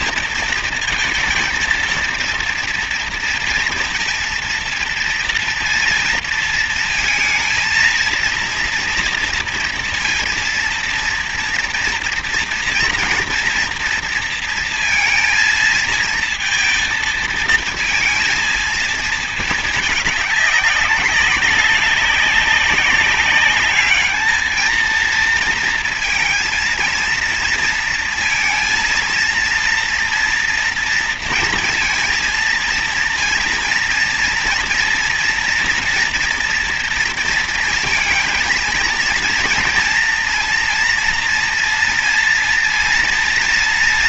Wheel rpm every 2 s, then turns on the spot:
230, 230, 230, 230, 230, 230, 230, 230, 230, 230, 200, 200, 220, 230, 230, 230, 230, 230, 230, 230, 240, 230.
none